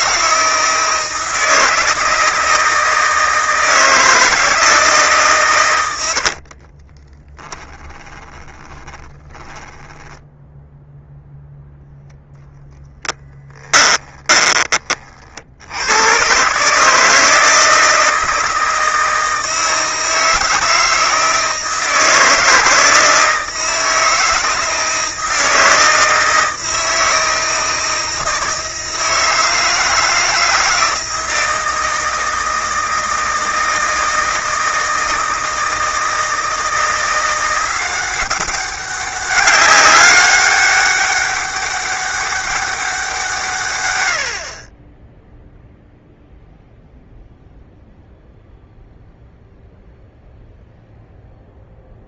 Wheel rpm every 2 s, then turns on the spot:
160, 160, 160, 20, 20, 0, 10, 30, 150, 160, 160, 160, 160, 160, 160, 160, 160, 160, 170, 190, 200, 180, 20, 0, 0, 0.
6-10 12-14